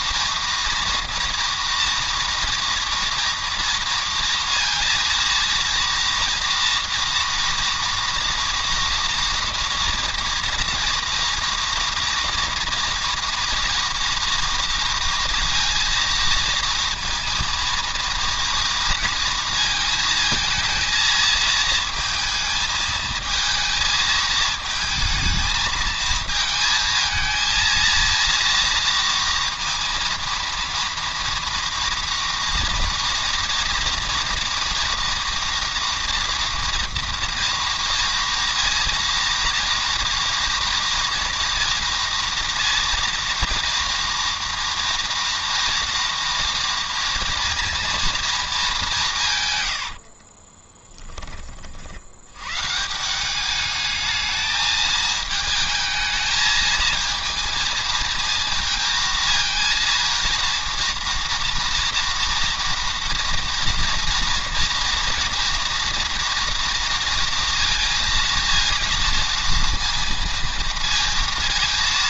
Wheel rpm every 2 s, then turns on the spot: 230, 230, 230, 230, 240, 230, 230, 230, 230, 230, 230, 220, 220, 220, 230, 230, 230, 230, 230, 230, 230, 230, 230, 230, 210, 10, 140, 220, 230, 230, 230, 230, 230, 230, 230, 230.
50-52